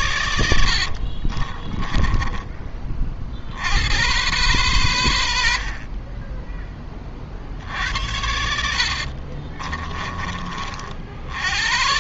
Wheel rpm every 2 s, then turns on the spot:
70, 30, 100, 30, 60, 50.
0-2 8-10